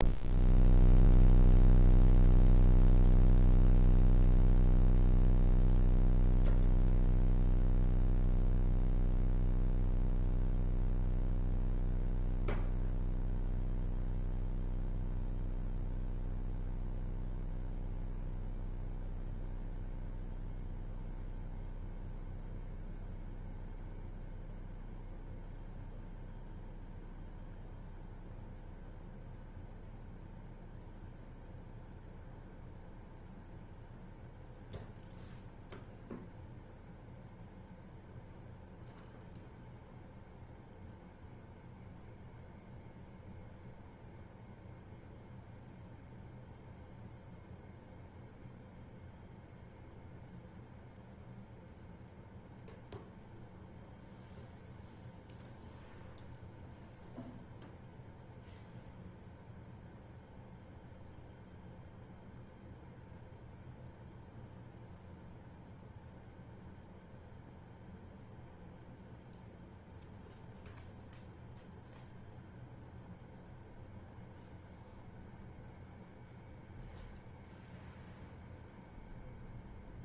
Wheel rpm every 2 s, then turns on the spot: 0, 0, 0, 0, 0, 0, 0, 0, 0, 0, 0, 0, 0, 0, 0, 0, 0, 0, 0, 0, 0, 0, 0, 0, 0, 0, 0, 0, 0, 0, 0, 0, 0, 0, 0, 0, 0, 0, 0, 0.
none